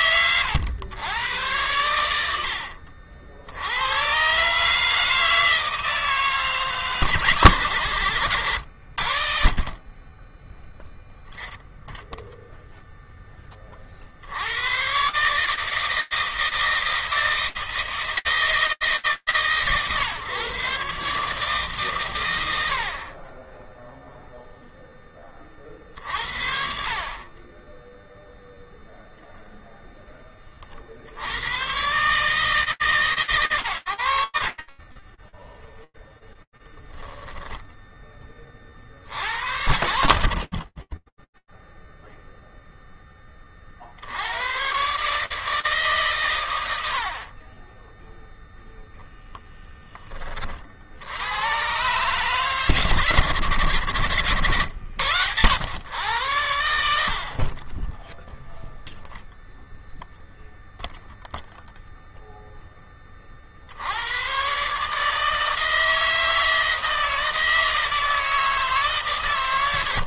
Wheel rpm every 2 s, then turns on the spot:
110, 80, 140, 160, 90, 10, 0, 100, 160, 150, 130, 80, 10, 40, 0, 80, 130, 10, 10, 90, 20, 0, 130, 80, 0, 60, 110, 100, 60, 0, 0, 70, 160, 160, 140.
34-36